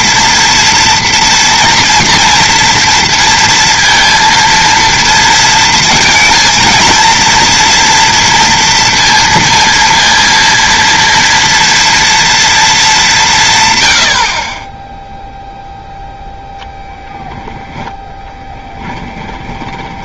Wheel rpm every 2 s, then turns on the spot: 240, 230, 230, 220, 230, 230, 220, 20, 0, 10.
18-20